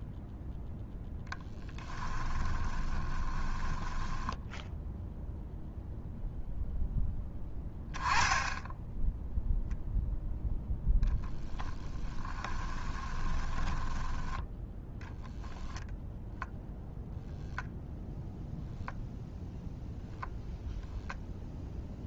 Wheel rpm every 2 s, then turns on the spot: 0, 20, 0, 0, 10, 10, 30, 10, 0, 0, 0.
2-4 10-14